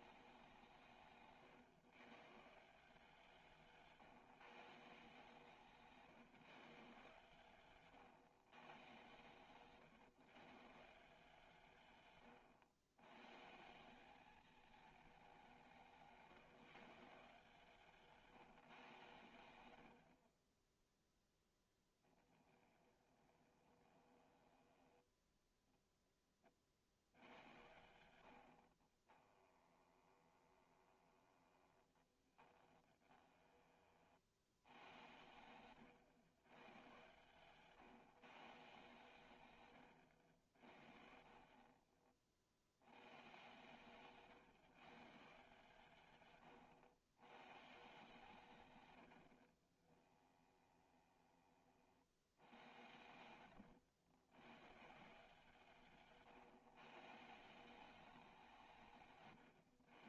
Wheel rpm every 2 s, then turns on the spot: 170, 160, 160, 150, 120, 150, 110, 220, 150, 150, 10, 20, 10, 40, 60, 20, 20, 80, 120, 140, 70, 80, 130, 120, 120, 20, 100, 140, 140, 170.
22-26 28-34 40-42 46-48 50-52